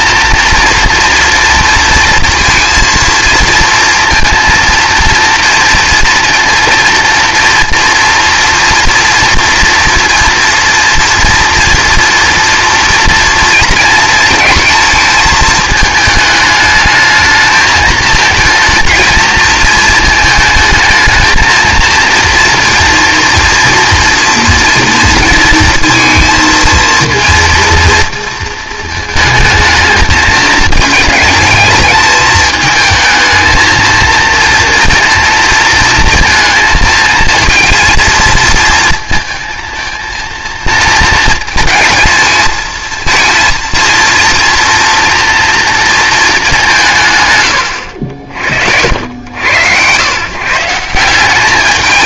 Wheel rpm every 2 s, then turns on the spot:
230, 230, 230, 230, 230, 230, 230, 230, 220, 230, 220, 230, 230, 230, 220, 220, 220, 230, 230, 230, 230, 220, 240, 180, 60, 160.
none